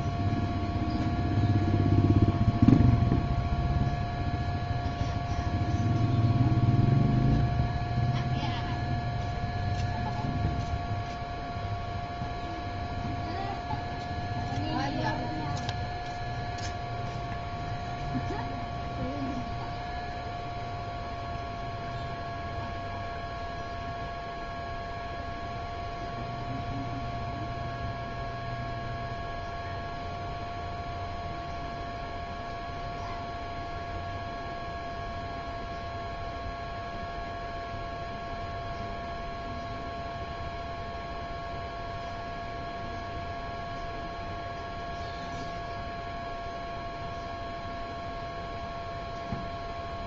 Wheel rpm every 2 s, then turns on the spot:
0, 0, 0, 0, 0, 0, 0, 0, 0, 0, 0, 0, 0, 0, 0, 0, 0, 0, 0, 0, 0, 0, 0, 0, 0.
none